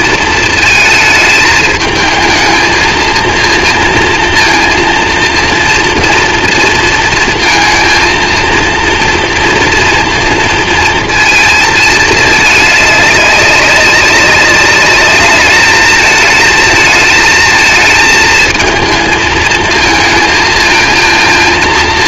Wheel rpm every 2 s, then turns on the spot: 220, 220, 230, 230, 230, 230, 210, 200, 220, 220, 230.
none